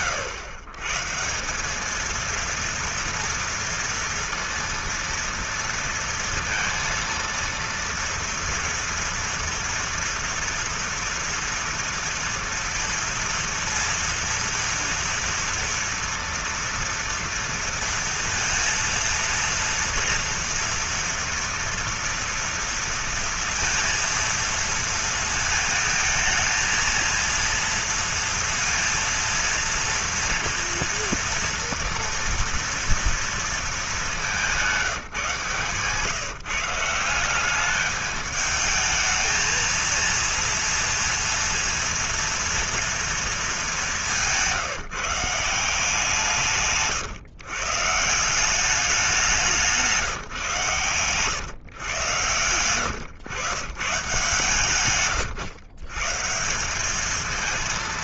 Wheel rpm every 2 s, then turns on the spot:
120, 230, 230, 230, 230, 230, 230, 230, 230, 230, 230, 230, 230, 230, 230, 230, 230, 170, 170, 220, 230, 230, 170, 140, 190, 140, 130, 130, 210.
none